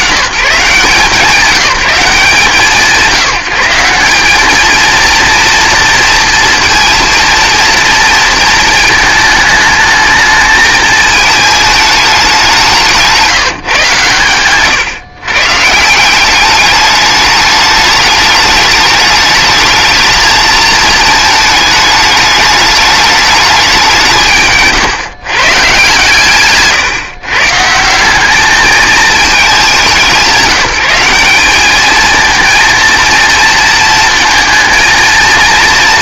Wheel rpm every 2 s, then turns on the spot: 110, 160, 220, 230, 220, 220, 180, 120, 200, 210, 220, 210, 160, 140, 220, 170, 230, 230.
26-28